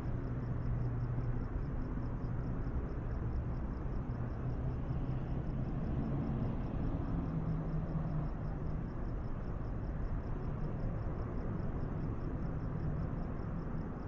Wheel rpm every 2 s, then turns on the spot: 0, 0, 0, 0, 0, 0, 0.
none